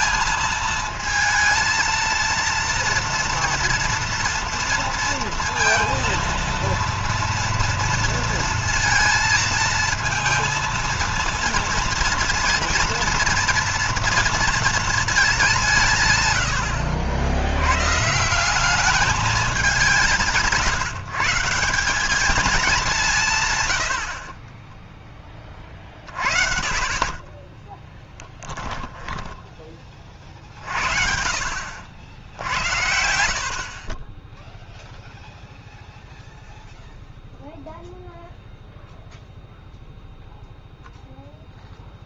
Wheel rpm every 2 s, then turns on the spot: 220, 230, 230, 230, 230, 230, 230, 220, 80, 200, 160, 190, 20, 30, 10, 50, 70, 0, 0, 0, 0.
24-26 28-30